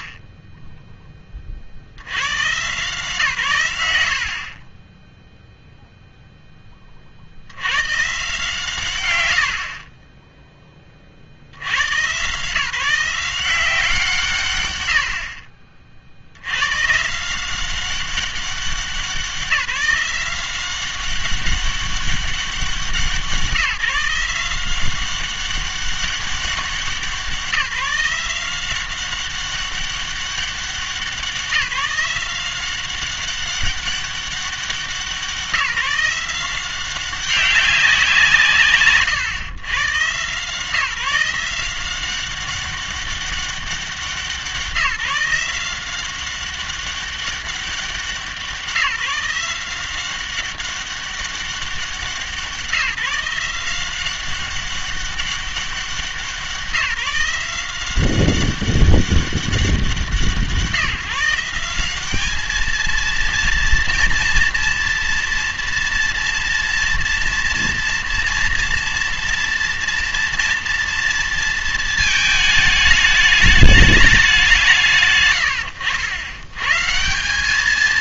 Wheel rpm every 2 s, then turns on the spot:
20, 140, 50, 10, 110, 10, 160, 90, 110, 190, 190, 180, 180, 190, 180, 190, 190, 190, 190, 140, 150, 190, 180, 190, 180, 190, 180, 200, 170, 190, 170, 220, 230, 230, 230, 230, 210, 170, 120.
0-2